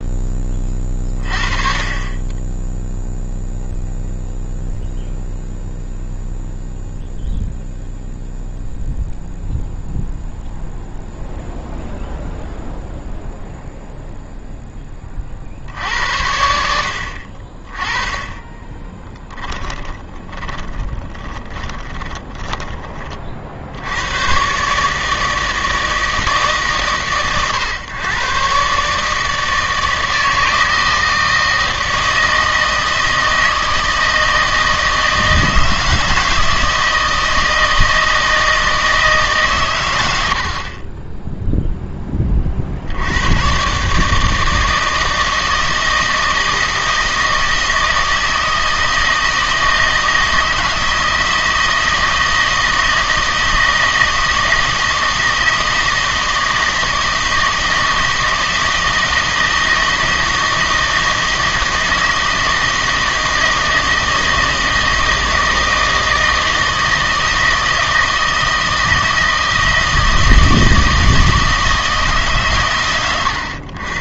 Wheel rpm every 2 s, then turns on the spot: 20, 10, 0, 0, 0, 0, 0, 10, 70, 20, 20, 10, 140, 140, 130, 160, 160, 160, 160, 160, 50, 50, 160, 160, 160, 160, 160, 160, 160, 160, 160, 160, 160, 160, 160, 160, 130.
18-22